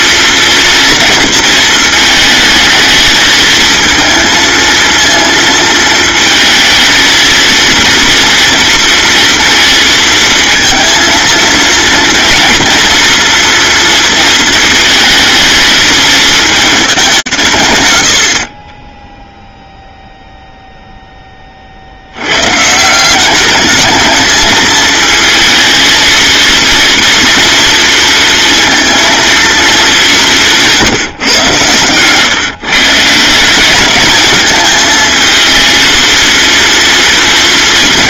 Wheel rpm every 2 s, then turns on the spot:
230, 220, 230, 230, 230, 230, 240, 220, 190, 10, 10, 180, 220, 230, 230, 130, 160, 220, 230.
none